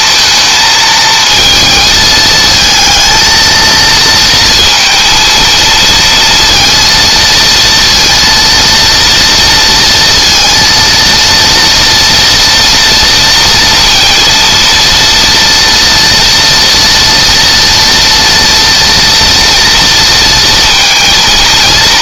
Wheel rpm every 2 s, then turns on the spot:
220, 220, 230, 230, 230, 230, 230, 230, 230, 230, 230.
none